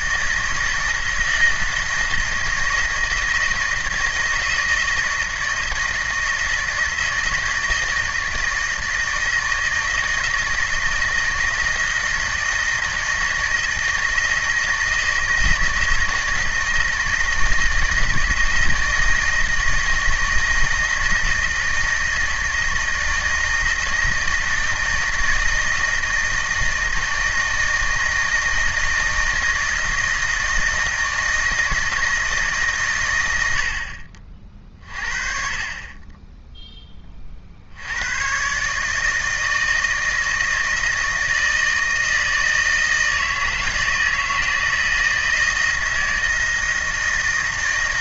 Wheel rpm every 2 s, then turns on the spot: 160, 160, 160, 160, 160, 170, 160, 160, 160, 170, 160, 160, 160, 160, 160, 160, 140, 40, 20, 140, 160, 160, 160, 160.
none